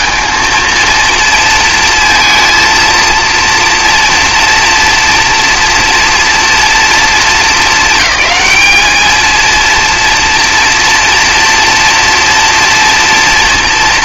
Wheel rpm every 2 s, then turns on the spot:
230, 230, 230, 230, 220, 240, 230.
none